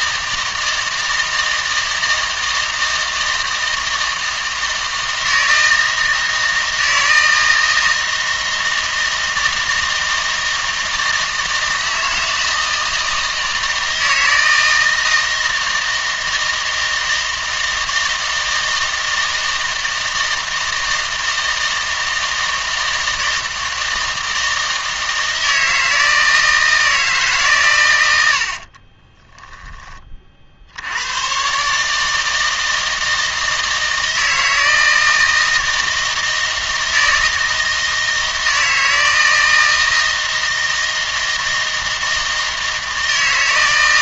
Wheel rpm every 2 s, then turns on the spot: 160, 160, 160, 160, 160, 160, 160, 160, 160, 160, 160, 160, 160, 160, 50, 70, 160, 160, 160, 160, 160, 160.
28-30